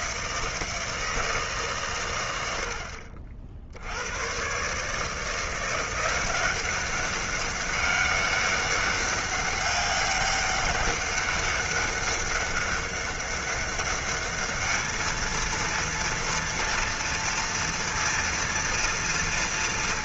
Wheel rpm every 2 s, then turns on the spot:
160, 90, 130, 190, 200, 200, 200, 220, 230, 230.
none